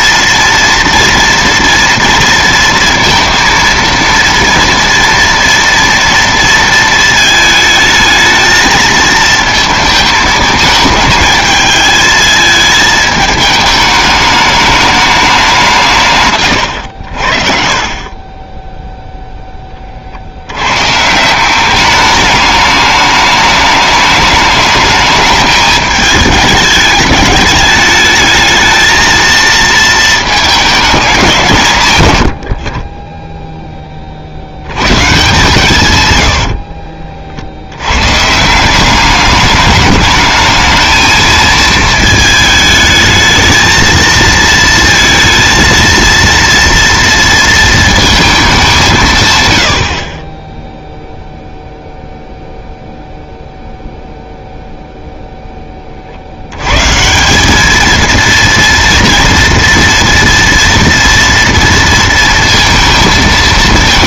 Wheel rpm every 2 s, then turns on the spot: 230, 230, 230, 230, 220, 220, 220, 210, 110, 10, 100, 210, 210, 210, 220, 210, 40, 120, 50, 180, 220, 220, 230, 230, 180, 0, 0, 0, 110, 230, 230, 230.
16-20 36-38